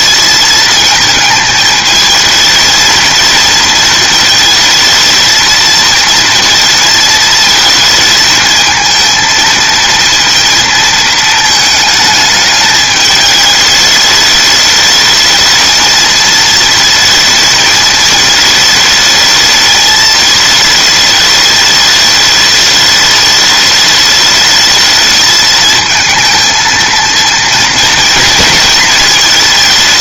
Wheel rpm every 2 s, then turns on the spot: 220, 220, 220, 220, 230, 230, 220, 210, 220, 220, 220, 210, 210, 220, 230.
none